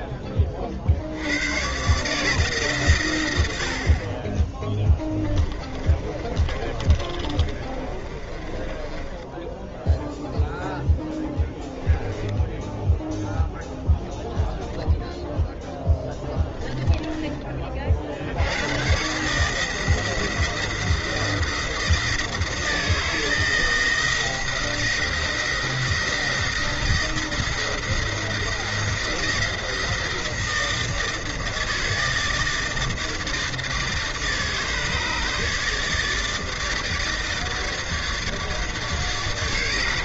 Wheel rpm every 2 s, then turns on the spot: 30, 150, 10, 30, 20, 0, 10, 0, 20, 90, 170, 160, 170, 170, 170, 160, 160, 150, 160, 150.
6-10 16-18